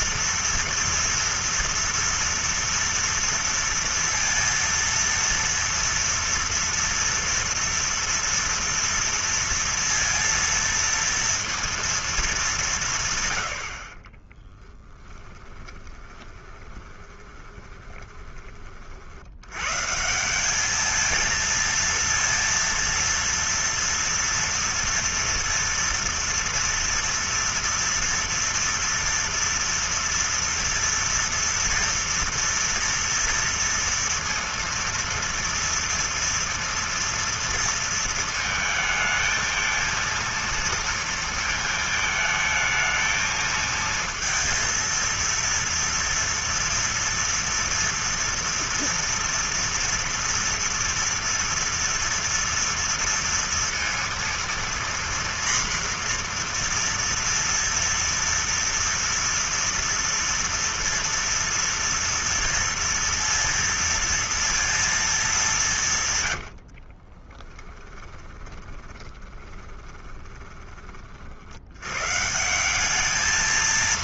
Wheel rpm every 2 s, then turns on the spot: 230, 230, 230, 230, 240, 230, 190, 50, 20, 30, 190, 230, 230, 230, 230, 230, 230, 230, 230, 220, 230, 220, 230, 230, 230, 230, 230, 230, 240, 240, 240, 230, 230, 80, 20, 20, 170.
14-18 66-70